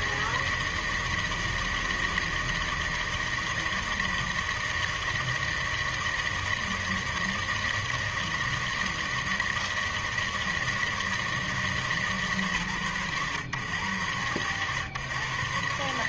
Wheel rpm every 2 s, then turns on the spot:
160, 160, 160, 160, 160, 160, 150, 110.
none